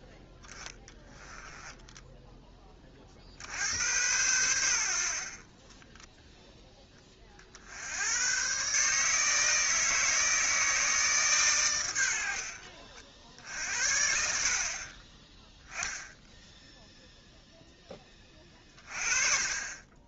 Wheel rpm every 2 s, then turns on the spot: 10, 20, 80, 10, 130, 160, 50, 50, 0, 30.
none